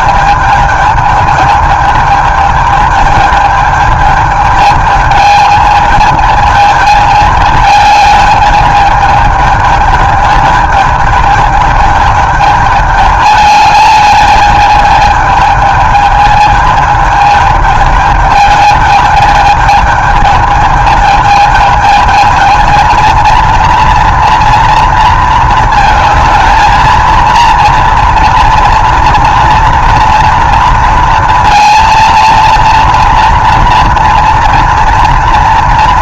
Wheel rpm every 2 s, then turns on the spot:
210, 210, 220, 220, 210, 210, 210, 210, 210, 210, 220, 220, 230, 230, 240, 230, 230, 230.
none